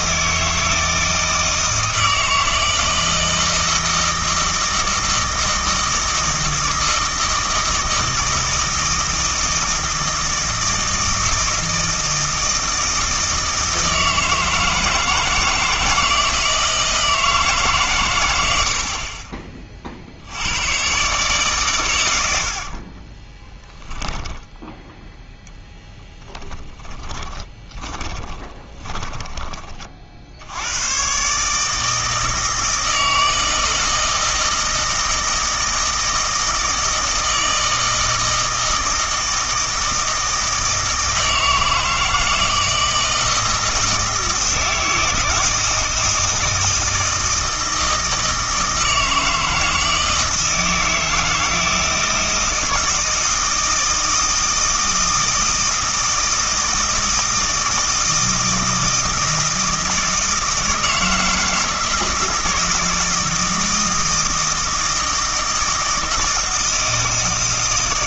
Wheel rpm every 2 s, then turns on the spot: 160, 160, 160, 160, 160, 160, 160, 160, 160, 70, 120, 50, 0, 10, 20, 100, 160, 160, 160, 160, 160, 160, 160, 160, 160, 160, 160, 160, 160, 160, 160, 160, 160, 160.
22-24 26-30